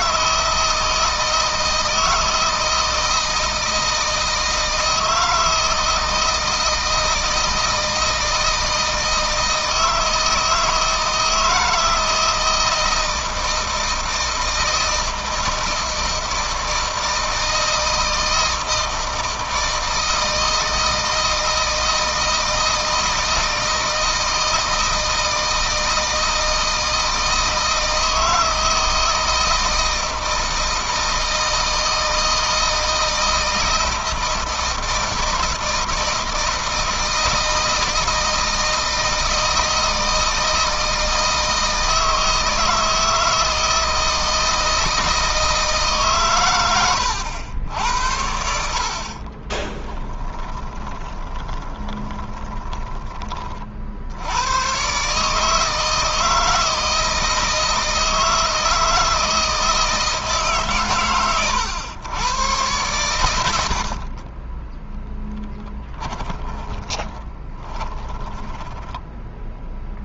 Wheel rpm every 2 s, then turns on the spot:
160, 160, 160, 160, 160, 160, 160, 160, 160, 160, 160, 160, 160, 160, 160, 160, 160, 160, 160, 160, 160, 160, 160, 100, 60, 20, 20, 120, 160, 160, 140, 110, 10, 10, 10.
48-54 66-70